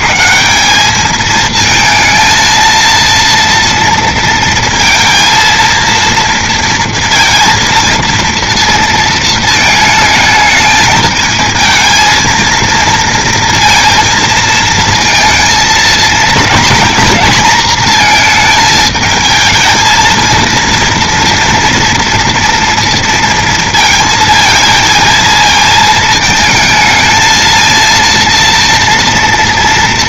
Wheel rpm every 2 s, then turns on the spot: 120, 230, 230, 230, 230, 220, 230, 230, 230, 220, 230, 230, 230, 220, 230.
none